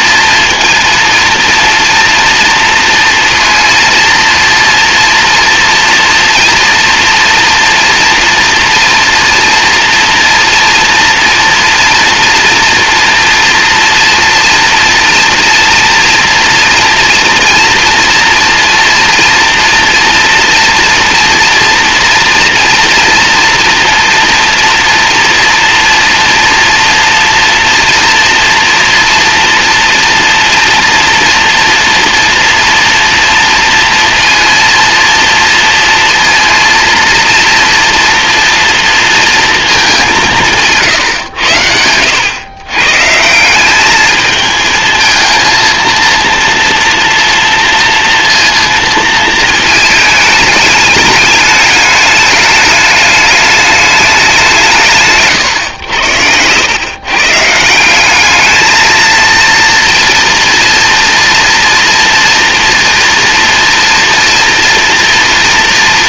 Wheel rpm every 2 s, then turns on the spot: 230, 230, 240, 240, 230, 230, 240, 230, 230, 230, 230, 230, 230, 230, 230, 230, 240, 230, 230, 230, 150, 150, 220, 230, 230, 210, 210, 160, 130, 220, 230, 230, 230.
none